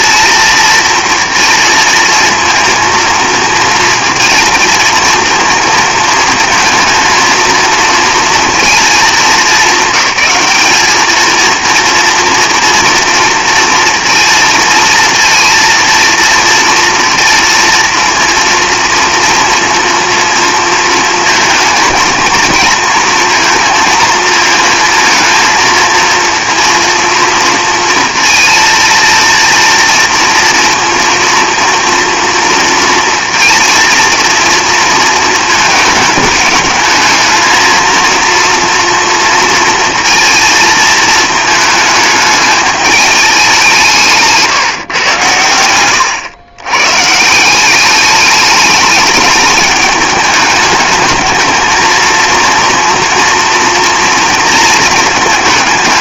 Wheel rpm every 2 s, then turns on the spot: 230, 230, 230, 230, 230, 210, 230, 230, 230, 230, 230, 230, 220, 230, 230, 230, 230, 230, 210, 230, 220, 210, 150, 110, 210, 210, 240, 230.
none